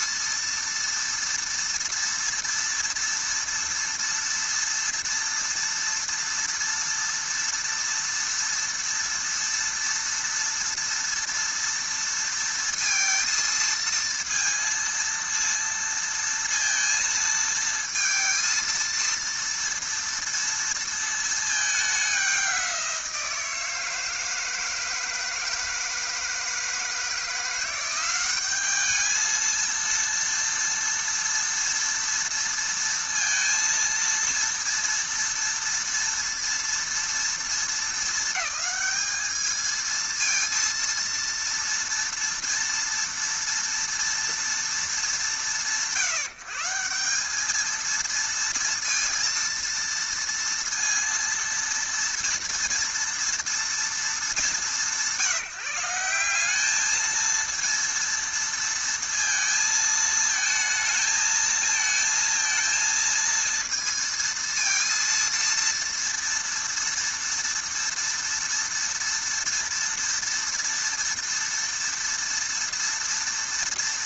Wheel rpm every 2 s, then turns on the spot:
230, 230, 230, 230, 230, 230, 230, 230, 230, 230, 230, 190, 160, 160, 200, 240, 230, 230, 230, 210, 230, 230, 230, 180, 230, 230, 230, 200, 200, 230, 220, 230, 230, 230, 230, 230, 230.
none